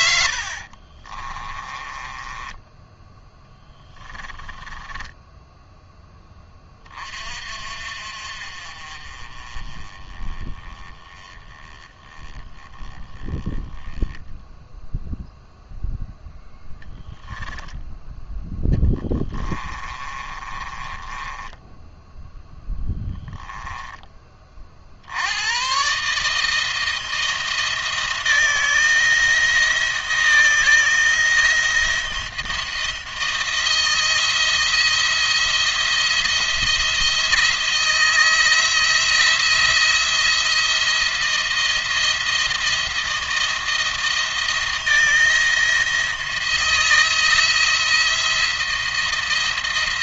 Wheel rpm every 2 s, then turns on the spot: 50, 10, 10, 20, 40, 20, 10, 0, 0, 10, 20, 10, 40, 160, 160, 170, 170, 160, 170, 170, 170, 170, 160, 170, 170.
0-2 4-6 18-24